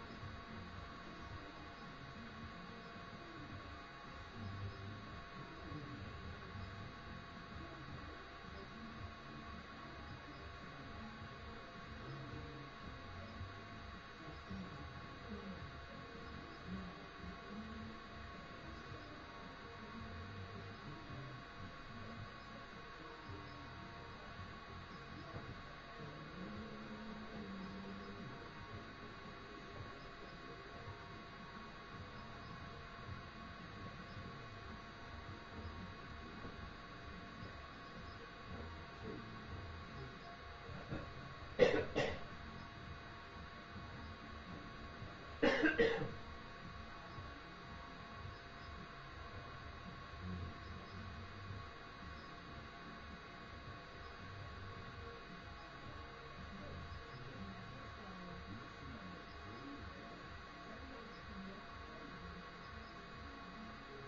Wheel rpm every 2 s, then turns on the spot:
0, 0, 0, 0, 0, 0, 0, 0, 0, 0, 0, 0, 0, 0, 0, 0, 0, 0, 0, 0, 0, 0, 0, 0, 0, 0, 0, 0, 0, 0, 0, 0.
none